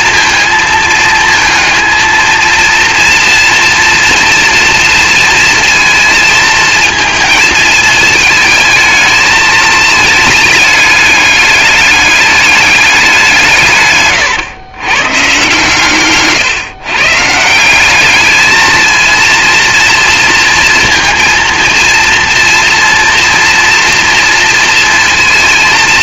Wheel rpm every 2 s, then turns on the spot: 220, 230, 230, 220, 220, 210, 190, 120, 130, 230, 230, 240, 230.
none